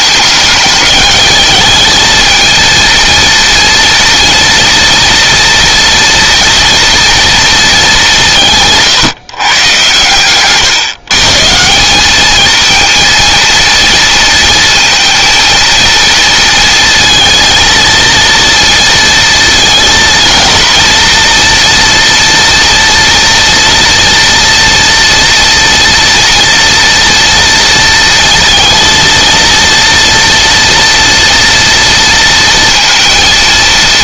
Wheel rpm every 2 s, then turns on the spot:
210, 230, 230, 230, 150, 120, 230, 230, 230, 230, 230, 230, 240, 230, 230, 230, 230.
none